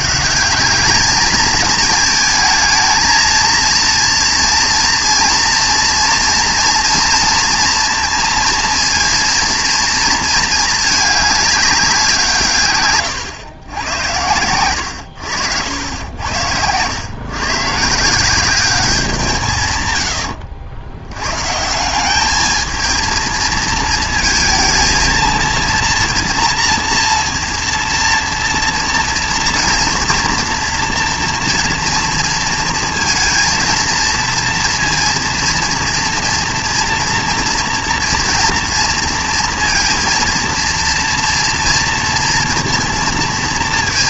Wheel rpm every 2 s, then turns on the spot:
210, 220, 230, 230, 230, 220, 130, 100, 100, 190, 80, 220, 230, 240, 230, 230, 230, 230, 230, 230, 230, 230.
none